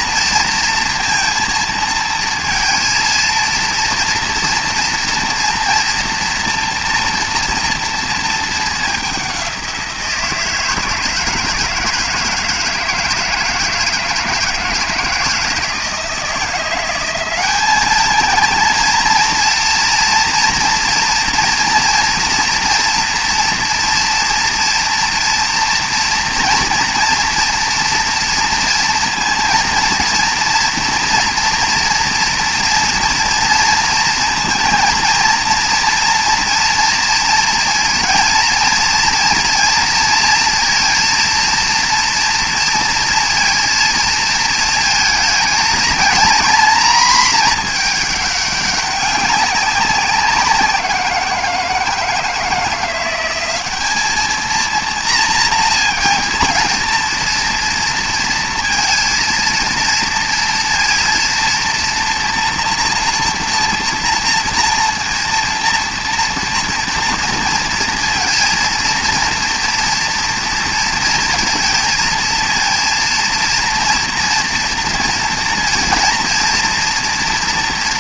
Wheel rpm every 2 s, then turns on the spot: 230, 230, 240, 230, 200, 160, 160, 160, 190, 230, 230, 230, 240, 230, 230, 230, 230, 230, 230, 230, 230, 230, 220, 230, 190, 170, 180, 230, 230, 230, 230, 240, 240, 230, 230, 230, 230, 230, 240.
none